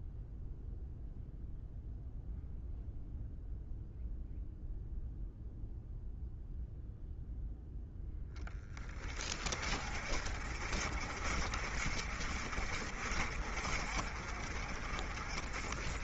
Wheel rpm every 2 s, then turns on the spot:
0, 0, 0, 0, 20, 50, 50, 40.
none